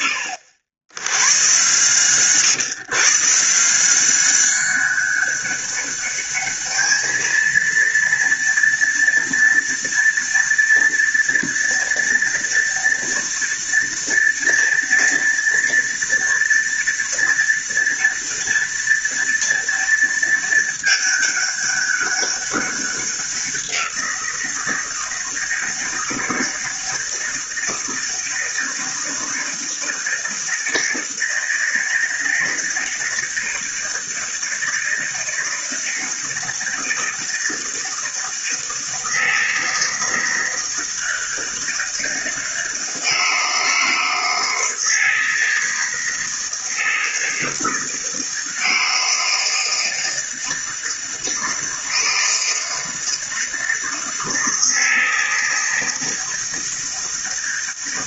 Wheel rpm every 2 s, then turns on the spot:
90, 150, 200, 220, 230, 230, 230, 230, 230, 230, 210, 190, 160, 160, 160, 160, 160, 160, 160, 160, 160, 160, 160, 160, 160, 160, 160, 160, 160.
none